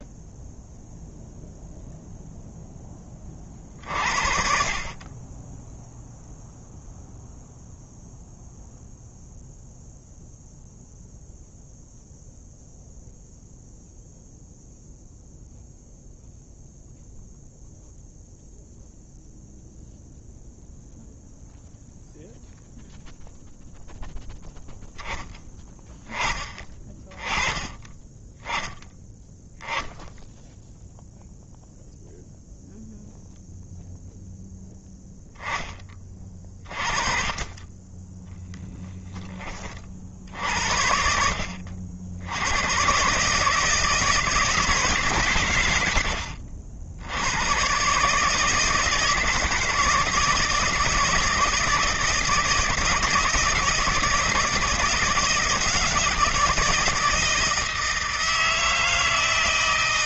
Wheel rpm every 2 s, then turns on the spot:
0, 20, 30, 0, 0, 0, 0, 0, 0, 0, 0, 0, 10, 20, 10, 0, 0, 0, 40, 10, 60, 130, 150, 80, 160, 160, 160, 160, 160, 160.
none